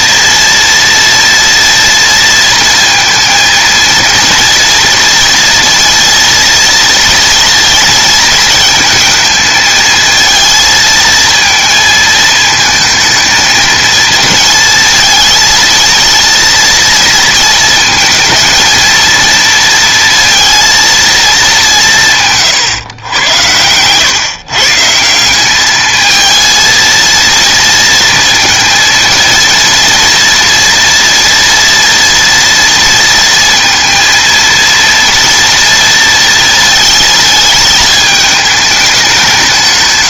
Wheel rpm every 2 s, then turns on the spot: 230, 230, 230, 230, 220, 220, 220, 220, 230, 220, 230, 140, 150, 230, 230, 230, 230, 230, 230, 220.
22-24